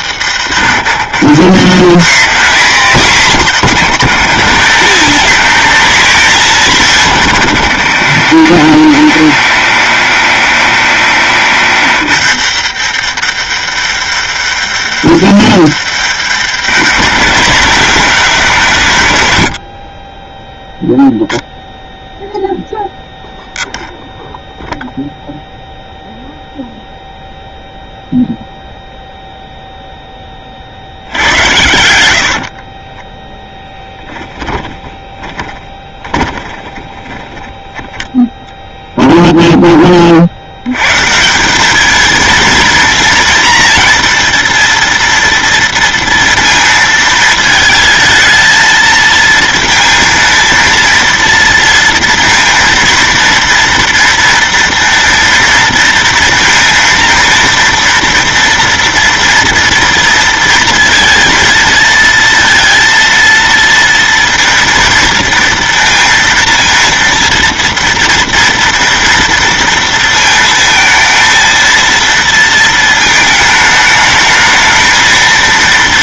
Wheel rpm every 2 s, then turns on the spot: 110, 160, 160, 180, 90, 80, 100, 90, 120, 140, 0, 0, 0, 0, 0, 50, 50, 20, 20, 10, 100, 230, 230, 230, 220, 230, 230, 230, 230, 230, 230, 230, 230, 230, 230, 230, 230, 220.
32-40